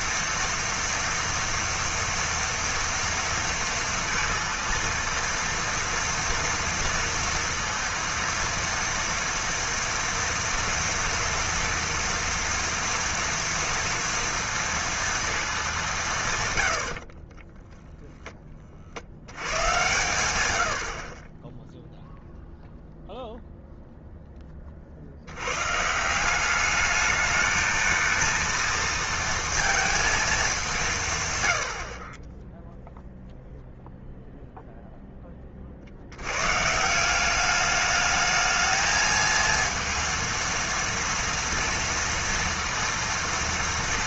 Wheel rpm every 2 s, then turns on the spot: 230, 230, 230, 230, 230, 230, 230, 230, 100, 30, 90, 0, 30, 200, 230, 180, 0, 0, 140, 220, 230, 230.
none